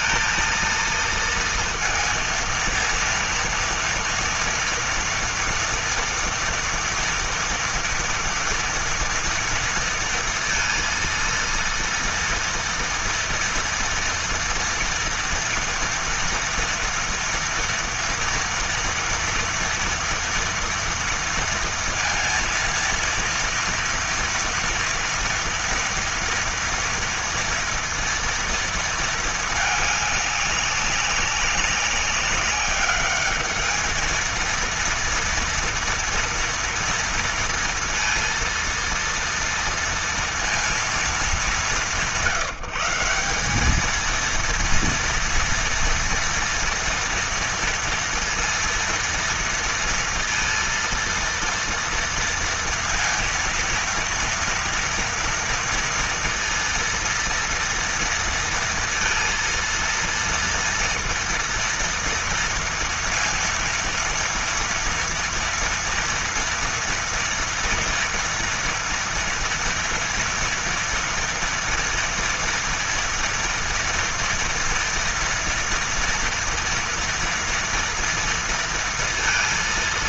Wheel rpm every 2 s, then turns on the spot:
230, 230, 230, 230, 230, 230, 230, 230, 230, 230, 230, 230, 230, 230, 230, 190, 210, 230, 230, 230, 210, 180, 230, 230, 230, 230, 230, 230, 230, 230, 230, 230, 230, 230, 230, 230, 230, 230, 230, 230.
none